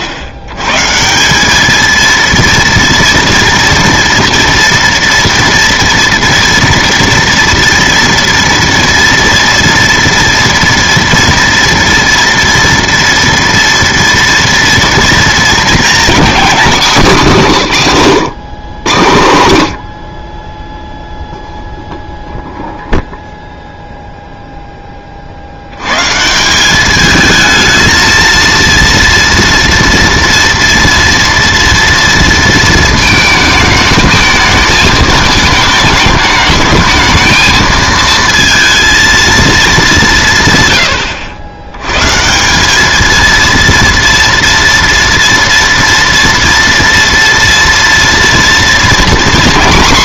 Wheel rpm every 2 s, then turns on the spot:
120, 230, 230, 230, 230, 230, 230, 240, 230, 120, 10, 0, 0, 190, 230, 230, 230, 220, 220, 230, 130, 200, 230, 230, 230.
none